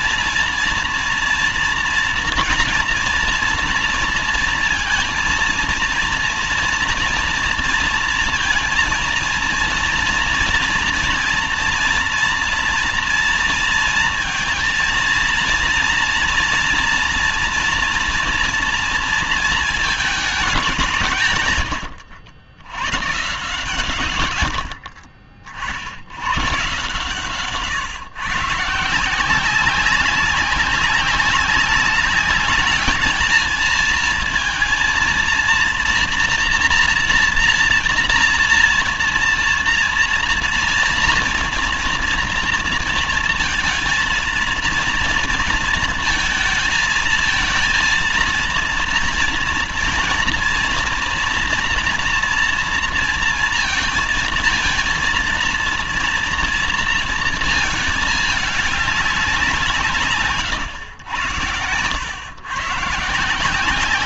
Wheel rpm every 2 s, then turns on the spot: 230, 240, 230, 230, 230, 230, 230, 230, 240, 230, 190, 80, 80, 120, 140, 200, 210, 230, 240, 230, 230, 230, 230, 230, 230, 240, 230, 230, 230, 210, 140, 130.
none